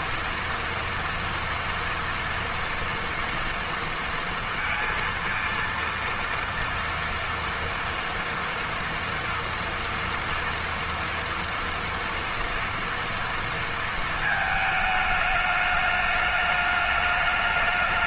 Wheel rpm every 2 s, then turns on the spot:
230, 230, 230, 230, 230, 240, 230, 220, 210.
none